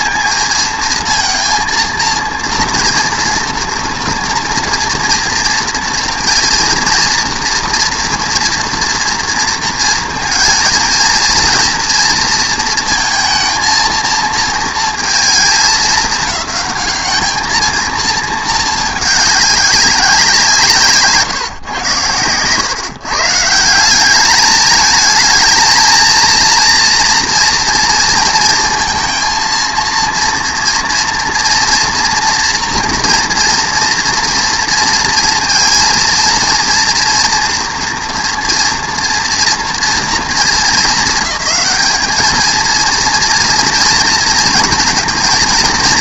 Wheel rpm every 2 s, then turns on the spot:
230, 230, 230, 230, 240, 230, 230, 220, 200, 220, 160, 130, 210, 230, 230, 230, 230, 230, 230, 230, 220, 220, 240.
none